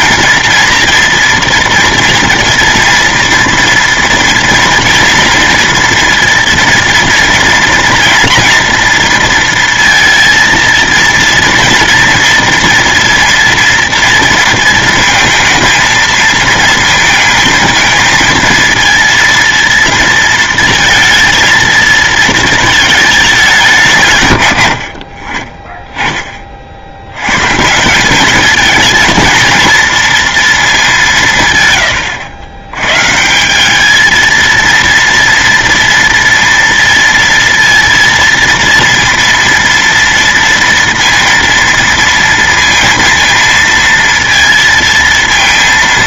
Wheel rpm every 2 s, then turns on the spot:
230, 230, 230, 230, 230, 230, 230, 230, 230, 230, 230, 220, 100, 60, 220, 210, 110, 230, 230, 230, 230, 230, 230.
none